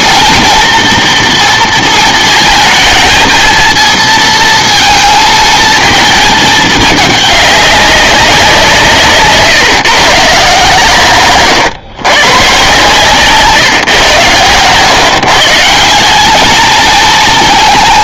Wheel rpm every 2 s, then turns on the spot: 230, 230, 220, 210, 170, 140, 130, 120, 220.
none